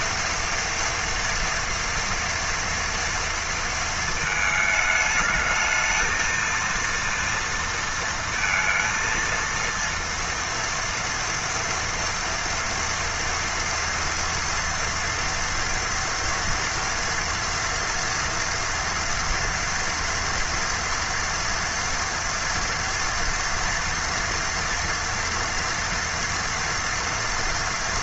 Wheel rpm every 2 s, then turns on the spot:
230, 230, 220, 230, 230, 230, 230, 230, 230, 230, 230, 230, 230, 230.
none